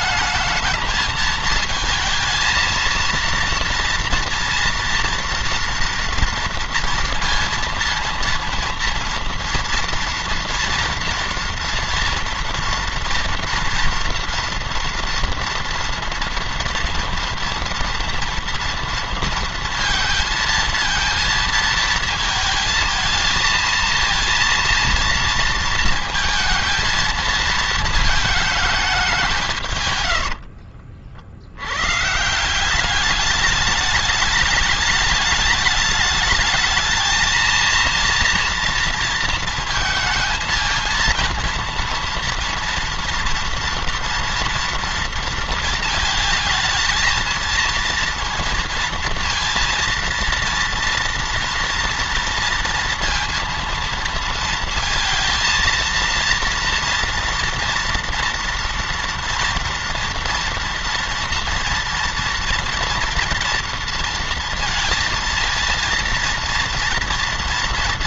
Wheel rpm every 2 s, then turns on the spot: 220, 230, 230, 230, 230, 240, 230, 230, 230, 230, 220, 230, 230, 230, 210, 50, 200, 210, 220, 230, 220, 230, 230, 220, 230, 230, 230, 230, 240, 230, 230, 230, 230, 230.
none